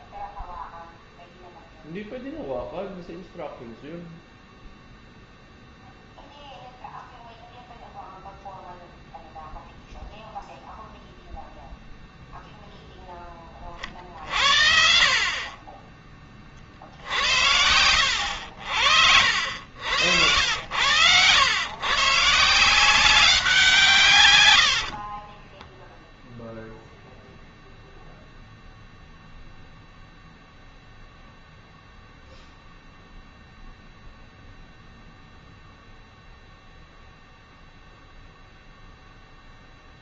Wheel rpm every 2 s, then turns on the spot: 0, 0, 0, 0, 0, 0, 0, 40, 40, 80, 90, 160, 90, 0, 0, 0, 0, 0, 0, 0.
24-26